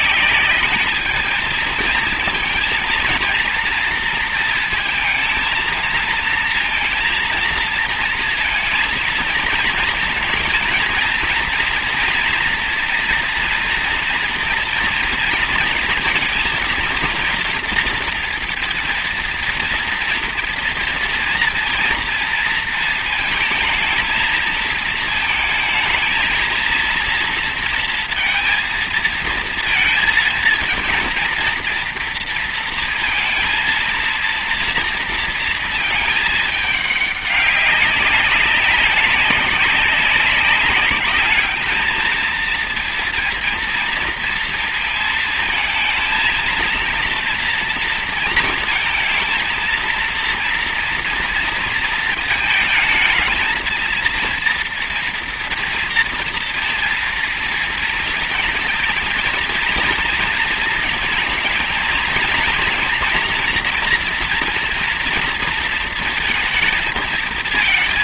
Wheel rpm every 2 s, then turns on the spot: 210, 230, 230, 230, 230, 230, 230, 230, 230, 230, 240, 230, 220, 230, 220, 230, 230, 230, 210, 200, 210, 230, 230, 230, 230, 230, 220, 230, 230, 230, 220, 230, 230, 230.
none